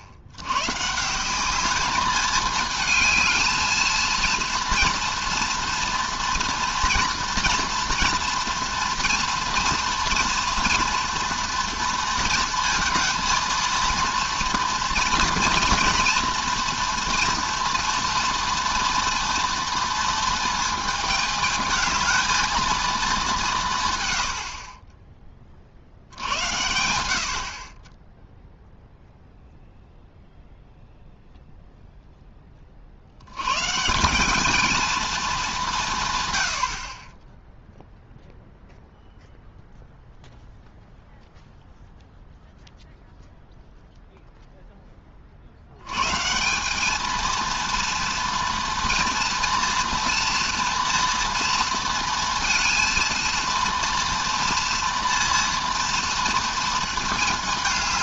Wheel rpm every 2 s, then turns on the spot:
90, 210, 230, 230, 230, 230, 220, 230, 240, 230, 220, 230, 50, 80, 0, 0, 30, 220, 80, 0, 0, 0, 0, 170, 230, 240, 230, 230, 230.
none